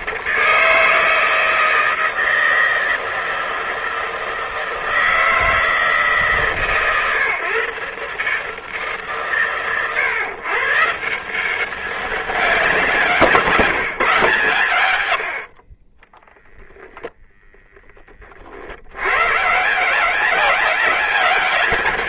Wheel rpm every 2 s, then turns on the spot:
160, 160, 160, 140, 140, 150, 180, 100, 10, 70, 190.
none